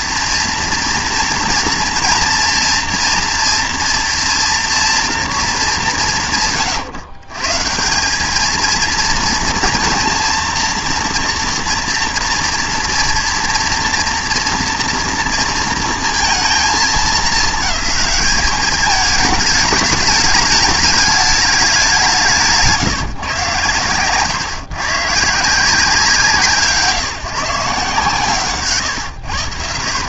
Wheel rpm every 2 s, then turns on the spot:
240, 230, 230, 140, 220, 230, 230, 230, 220, 210, 210, 150, 130, 160, 130.
none